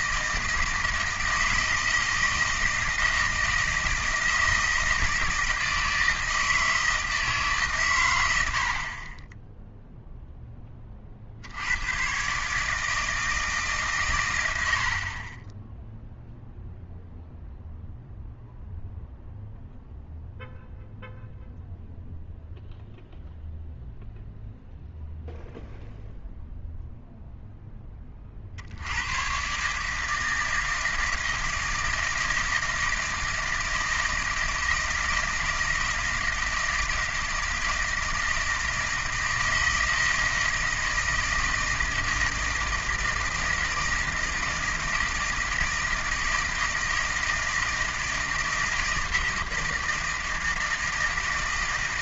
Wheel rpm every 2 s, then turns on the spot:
160, 160, 160, 160, 70, 10, 150, 80, 0, 0, 0, 0, 0, 0, 70, 160, 160, 160, 160, 160, 160, 160, 160, 160, 160, 160.
none